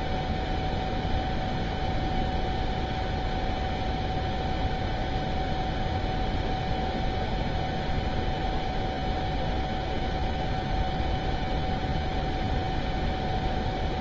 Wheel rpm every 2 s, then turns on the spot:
0, 0, 0, 0, 0, 0, 0.
none